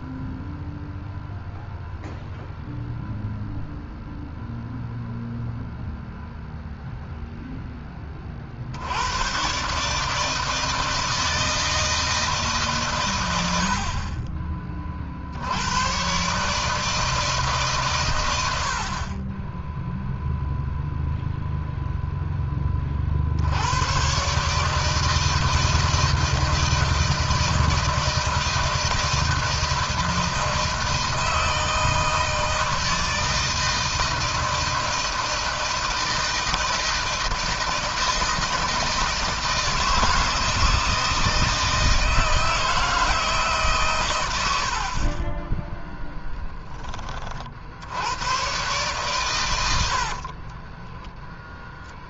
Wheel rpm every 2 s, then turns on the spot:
0, 0, 0, 0, 80, 160, 120, 50, 160, 40, 0, 40, 160, 160, 160, 160, 160, 160, 160, 160, 160, 160, 40, 20, 120, 10.
50-52